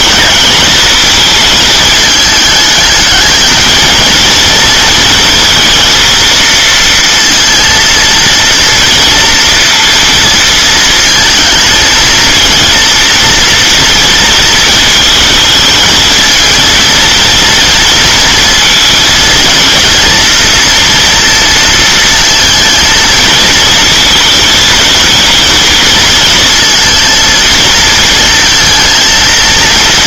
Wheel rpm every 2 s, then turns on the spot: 220, 210, 220, 230, 230, 230, 230, 220, 230, 230, 230, 220, 220, 230, 230.
none